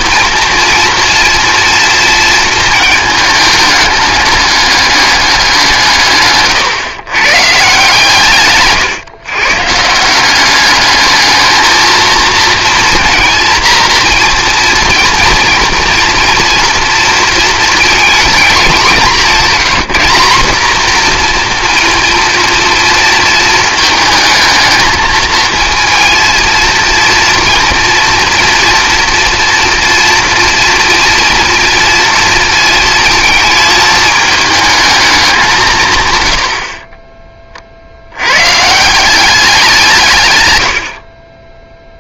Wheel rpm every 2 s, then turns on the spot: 240, 220, 210, 120, 130, 210, 230, 230, 240, 200, 230, 230, 220, 230, 230, 230, 230, 220, 30, 150, 80.
none